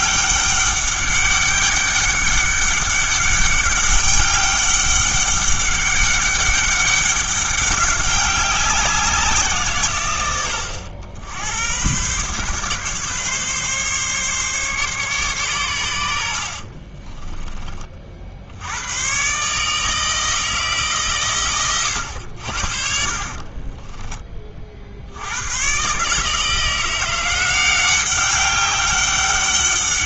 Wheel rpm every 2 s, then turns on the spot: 200, 200, 200, 200, 190, 80, 140, 140, 50, 80, 150, 60, 40, 160, 190.
16-18